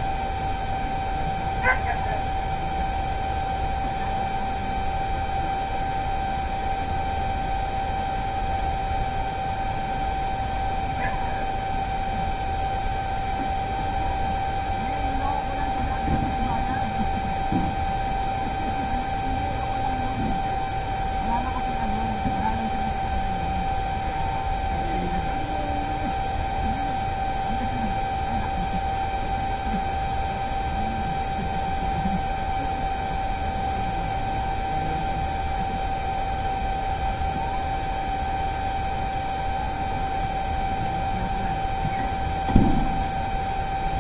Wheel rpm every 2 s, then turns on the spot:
0, 0, 0, 0, 0, 0, 0, 0, 0, 0, 0, 0, 0, 0, 0, 0, 0, 0, 0, 0, 0, 0.
none